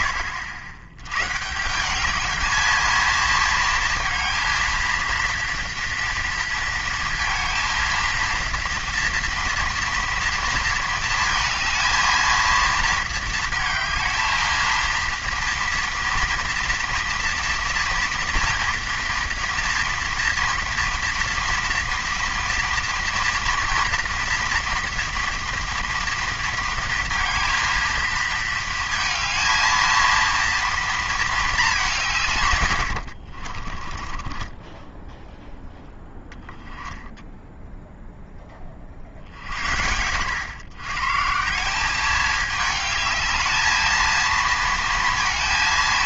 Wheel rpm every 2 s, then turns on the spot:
140, 230, 230, 230, 230, 220, 220, 230, 230, 230, 230, 230, 230, 230, 220, 220, 60, 0, 0, 50, 150, 220, 220.
32-34